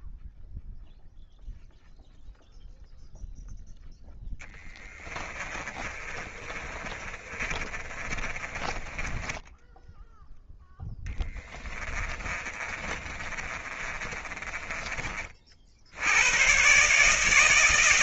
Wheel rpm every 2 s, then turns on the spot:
0, 0, 30, 30, 10, 30, 30, 70, 160.
4-14